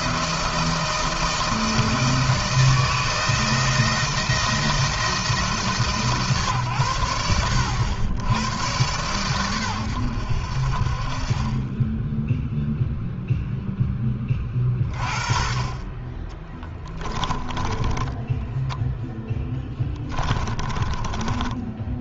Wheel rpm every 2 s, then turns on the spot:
160, 160, 170, 130, 110, 60, 0, 20, 10, 10, 20.
16-18 20-22